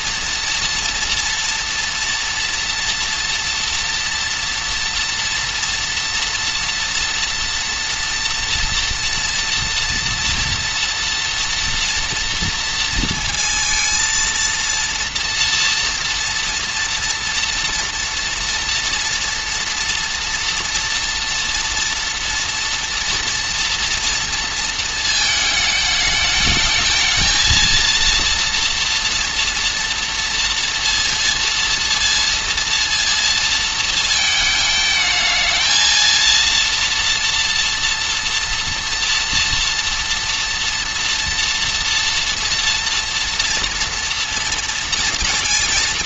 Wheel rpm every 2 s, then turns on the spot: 240, 240, 240, 240, 230, 230, 230, 230, 230, 230, 230, 230, 230, 220, 230, 230, 230, 220, 230, 240, 230, 230, 230.
none